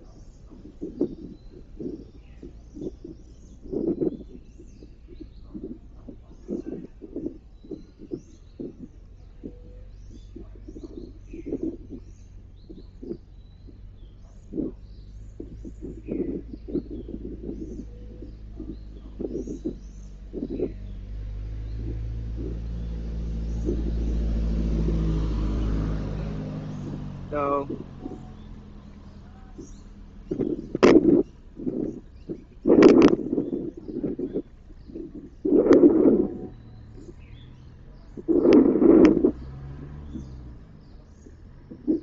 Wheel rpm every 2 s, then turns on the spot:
0, 0, 0, 0, 0, 0, 0, 0, 0, 0, 0, 0, 0, 0, 0, 0, 0, 0, 0, 0, 0.
none